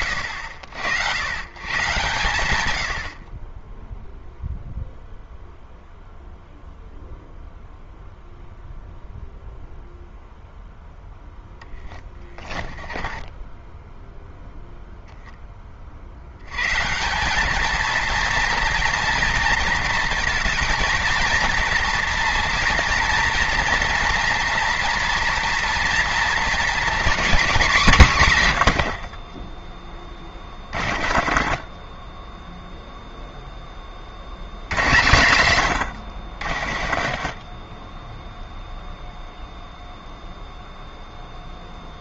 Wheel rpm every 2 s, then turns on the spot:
110, 100, 0, 0, 0, 0, 20, 0, 160, 230, 230, 230, 230, 230, 80, 50, 0, 120, 50, 0, 0.
12-14 28-32 36-38